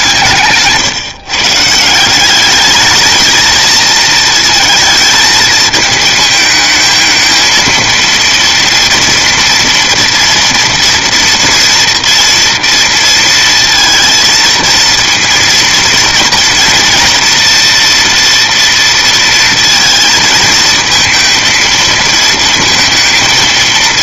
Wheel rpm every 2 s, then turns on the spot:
150, 200, 230, 220, 230, 230, 230, 230, 230, 230, 230, 230.
0-2